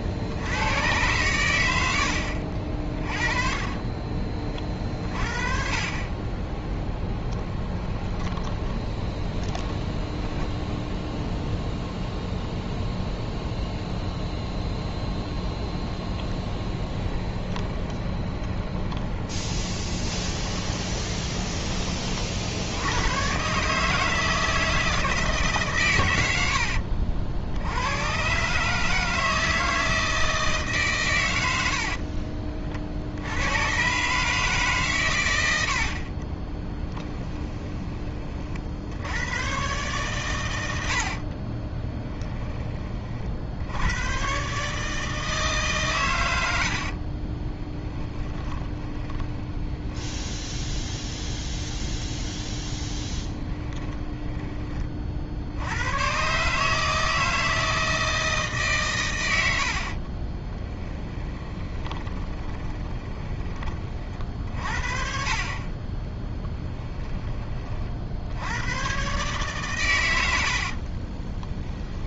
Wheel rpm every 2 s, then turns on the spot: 100, 50, 30, 10, 20, 0, 0, 0, 20, 30, 20, 90, 160, 60, 150, 130, 50, 130, 10, 80, 70, 30, 150, 50, 20, 10, 20, 30, 150, 130, 10, 20, 40, 10, 110, 50.
2-4 6-10 16-22 26-28 36-38 46-50 52-54 60-64 70-72